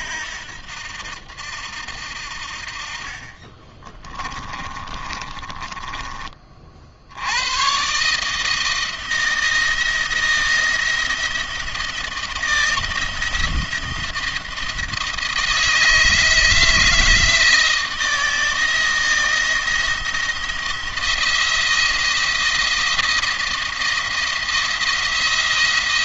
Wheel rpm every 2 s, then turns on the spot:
80, 60, 30, 40, 160, 170, 170, 160, 160, 160, 170, 170, 170.
2-6